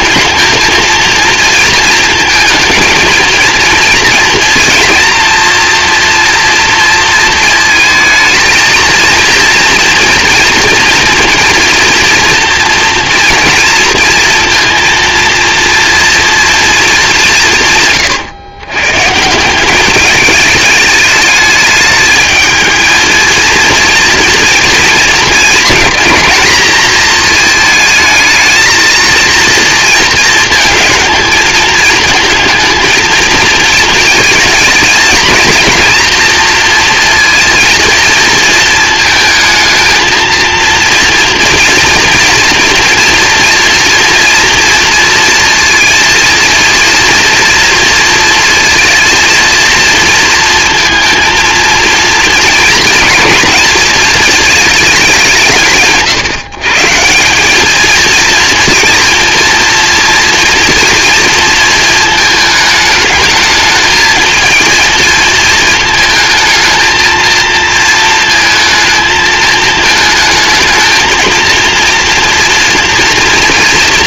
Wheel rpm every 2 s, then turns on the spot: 230, 220, 230, 230, 230, 230, 230, 230, 210, 120, 210, 220, 230, 230, 230, 230, 220, 220, 230, 220, 230, 230, 230, 230, 230, 230, 230, 200, 160, 230, 230, 220, 230, 230, 220, 220, 230.
none